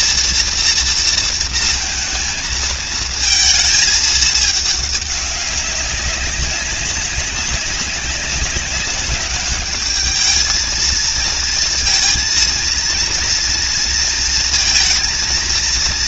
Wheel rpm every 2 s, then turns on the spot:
230, 230, 210, 190, 190, 220, 230, 230.
none